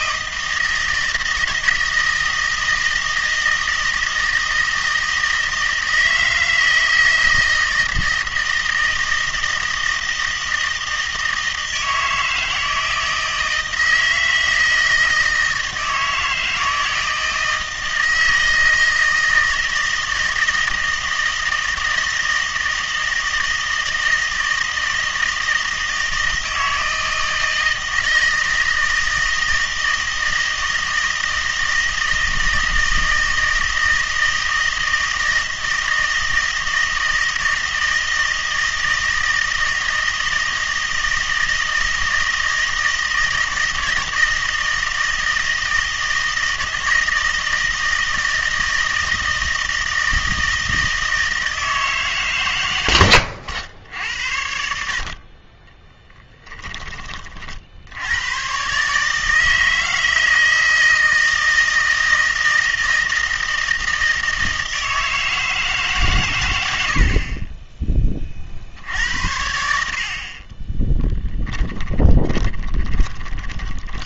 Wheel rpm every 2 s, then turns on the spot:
160, 160, 160, 160, 160, 160, 160, 160, 160, 160, 160, 160, 160, 160, 160, 160, 160, 160, 160, 160, 160, 160, 160, 160, 160, 160, 100, 60, 30, 140, 160, 160, 160, 80, 70, 30, 20.
56-58 70-74